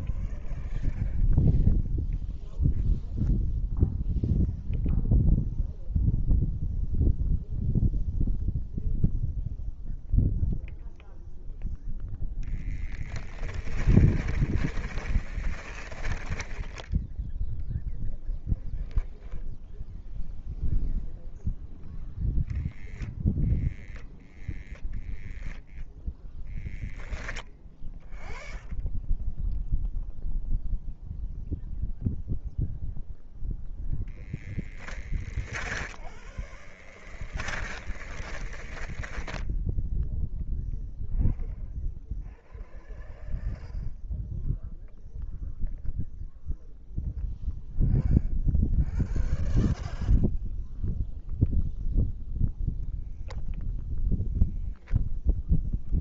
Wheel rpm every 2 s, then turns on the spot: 0, 0, 0, 0, 0, 0, 10, 10, 0, 0, 0, 0, 0, 0, 0, 0, 0, 10, 10, 10, 0, 0, 0, 0, 0, 0, 0, 0.
12-16 34-40